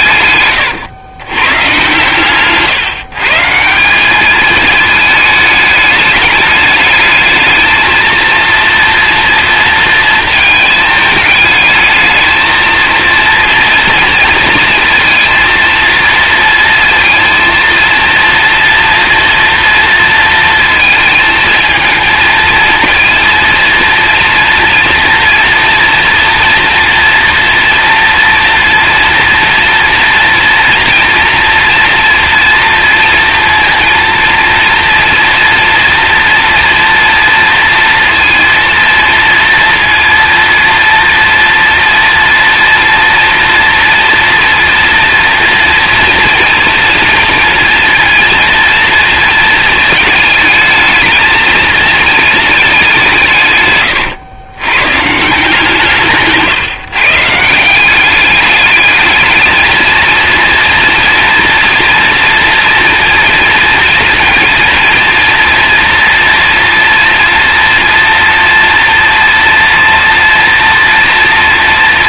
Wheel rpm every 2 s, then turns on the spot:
110, 150, 210, 210, 230, 220, 230, 230, 230, 230, 220, 230, 230, 240, 230, 230, 230, 230, 230, 230, 230, 230, 230, 230, 230, 220, 200, 130, 160, 210, 230, 230, 230, 230, 230, 230.
none